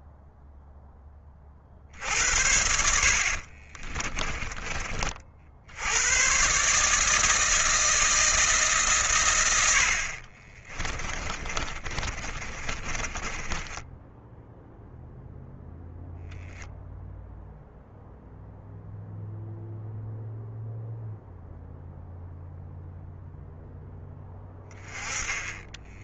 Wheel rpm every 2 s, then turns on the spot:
40, 30, 80, 160, 80, 30, 20, 10, 10, 0, 0, 0, 20.
2-4 10-18